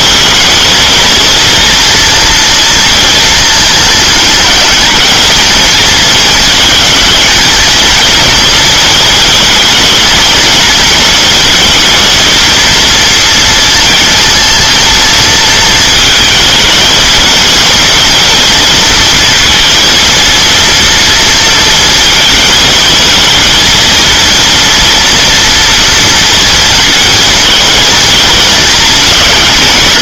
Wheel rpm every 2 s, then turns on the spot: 240, 230, 220, 230, 230, 220, 230, 230, 230, 230, 230, 230, 230, 220, 210.
none